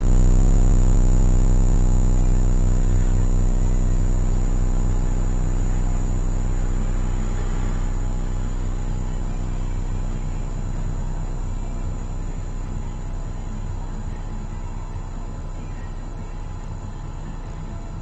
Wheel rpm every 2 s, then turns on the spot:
0, 0, 0, 0, 0, 0, 0, 0, 0.
none